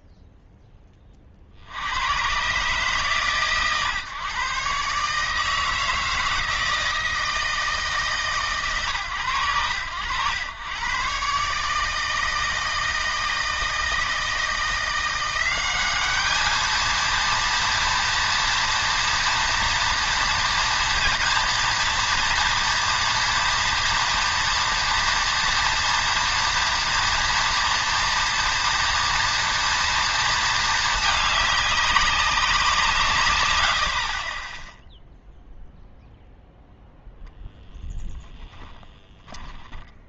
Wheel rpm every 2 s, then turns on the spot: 0, 130, 140, 160, 150, 100, 160, 170, 220, 240, 240, 230, 240, 240, 230, 230, 180, 10, 0, 0.
none